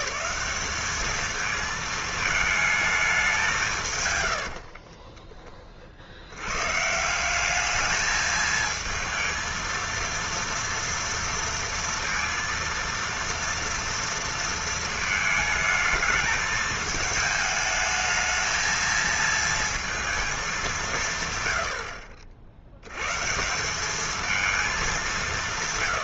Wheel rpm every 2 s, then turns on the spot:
160, 220, 70, 120, 220, 230, 230, 230, 220, 220, 210, 70, 220.
4-6